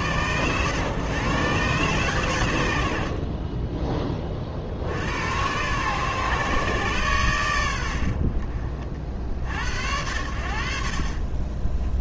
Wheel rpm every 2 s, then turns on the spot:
120, 70, 60, 130, 50, 50.
none